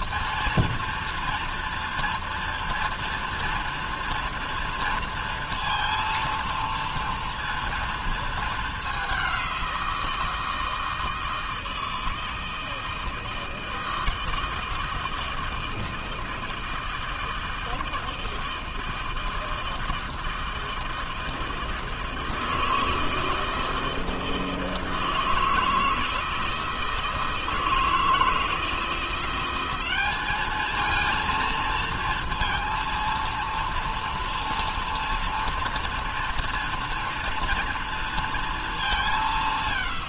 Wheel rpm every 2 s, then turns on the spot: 230, 230, 230, 230, 210, 160, 160, 160, 160, 160, 160, 160, 160, 160, 160, 220, 230, 230, 230, 220.
none